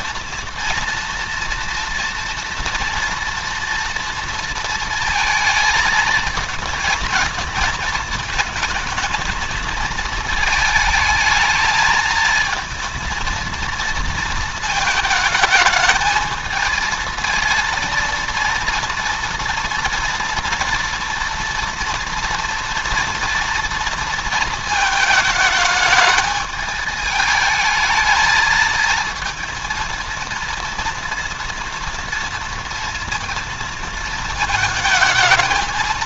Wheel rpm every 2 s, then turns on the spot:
230, 230, 230, 230, 220, 220, 230, 220, 220, 230, 230, 240, 220, 210, 220, 230, 230, 230.
none